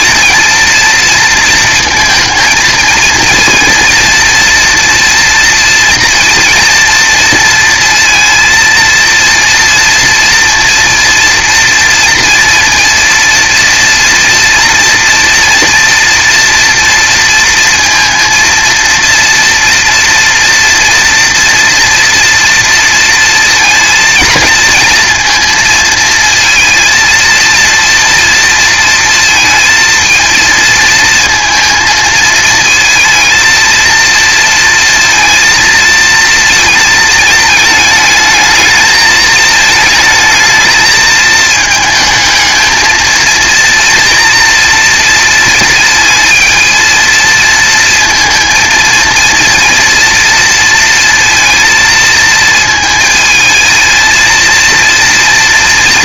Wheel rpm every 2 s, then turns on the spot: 230, 230, 240, 230, 230, 230, 230, 240, 230, 230, 230, 230, 230, 230, 230, 230, 230, 230, 220, 220, 220, 220, 230, 230, 230, 230, 220, 230.
none